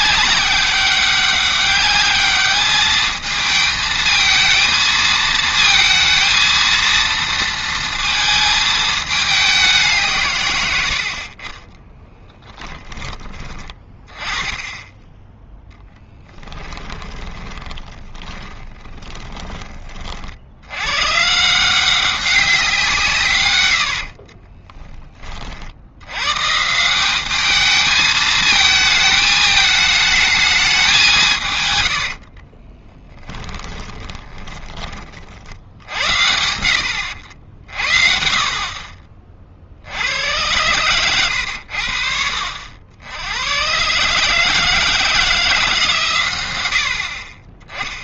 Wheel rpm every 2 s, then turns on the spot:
200, 210, 220, 230, 220, 100, 10, 10, 10, 10, 90, 190, 20, 160, 220, 200, 30, 20, 80, 40, 100, 70, 160, 90.
16-20 24-26 32-34